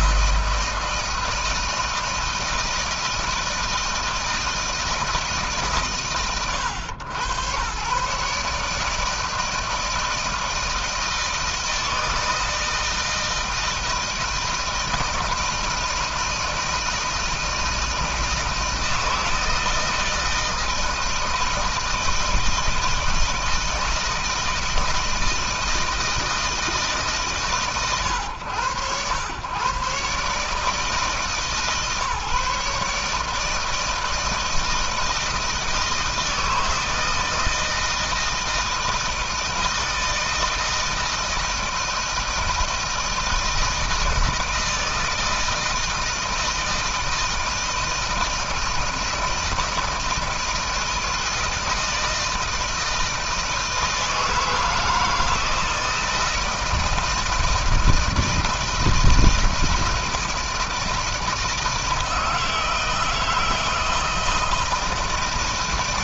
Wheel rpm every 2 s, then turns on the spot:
160, 160, 160, 110, 150, 160, 160, 160, 160, 170, 160, 160, 160, 160, 110, 150, 150, 160, 160, 160, 160, 160, 160, 160, 160, 160, 160, 160, 160, 160, 160, 160, 160.
none